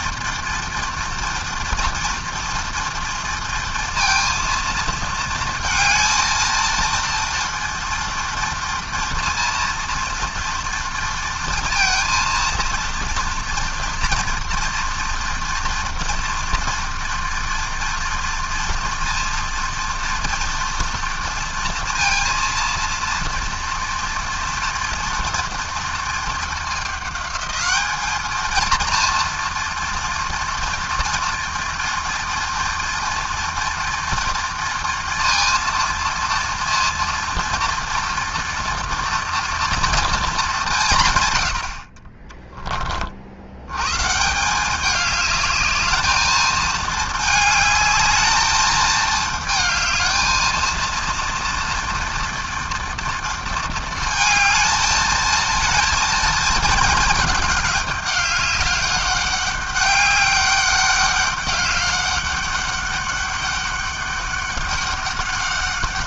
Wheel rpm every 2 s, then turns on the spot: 230, 230, 230, 230, 230, 230, 230, 230, 230, 230, 230, 230, 230, 210, 230, 230, 230, 230, 230, 240, 110, 80, 210, 220, 220, 240, 230, 220, 220, 200, 200, 200, 200.
none